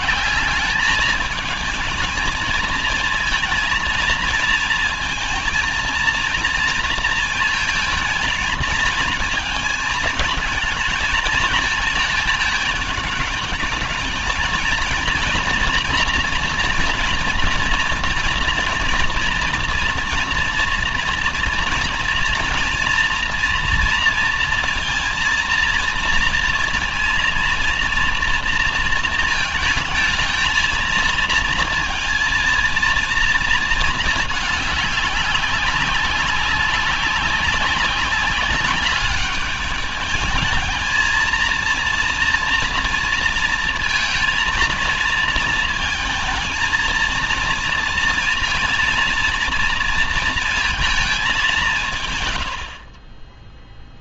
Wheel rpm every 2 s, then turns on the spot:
190, 220, 220, 240, 230, 220, 220, 220, 230, 230, 230, 240, 230, 230, 230, 220, 230, 210, 190, 200, 220, 230, 230, 220, 230, 230, 110.
none